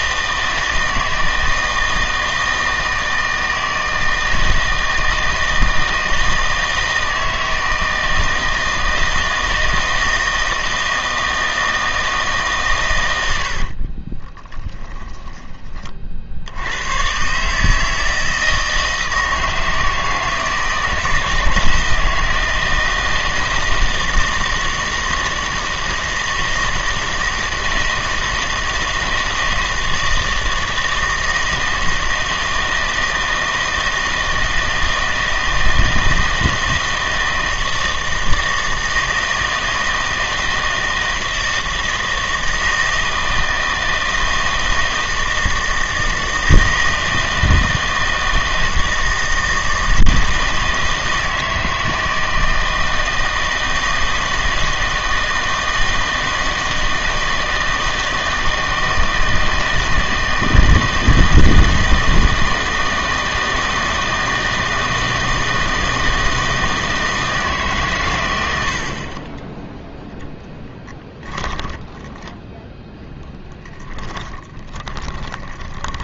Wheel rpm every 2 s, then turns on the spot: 160, 160, 160, 160, 160, 160, 130, 20, 100, 160, 160, 160, 160, 160, 160, 160, 160, 160, 160, 160, 160, 160, 160, 160, 160, 160, 160, 160, 160, 160, 160, 160, 160, 160, 80, 10, 0, 10.
14-16 70-72 74-76